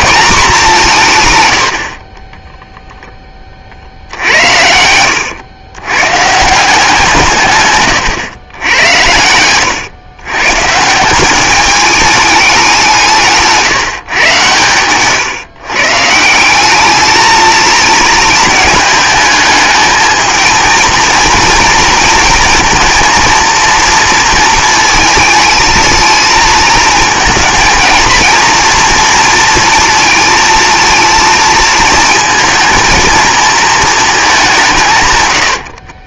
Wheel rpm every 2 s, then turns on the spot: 190, 0, 90, 170, 100, 150, 200, 130, 190, 220, 230, 230, 230, 220, 230, 230, 230, 180.
none